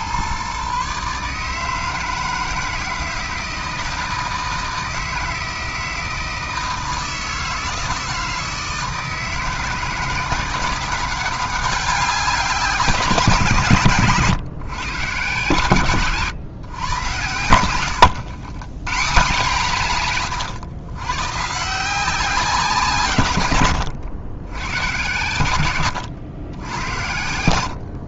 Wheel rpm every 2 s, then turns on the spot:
130, 160, 160, 160, 160, 170, 180, 120, 120, 140, 110, 180, 110, 90.
none